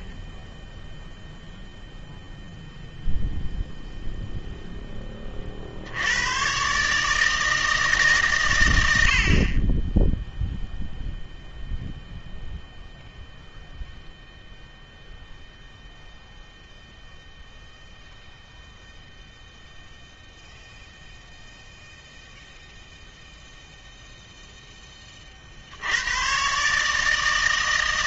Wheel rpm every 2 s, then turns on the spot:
10, 0, 0, 140, 100, 0, 0, 0, 0, 0, 0, 0, 10, 150.
none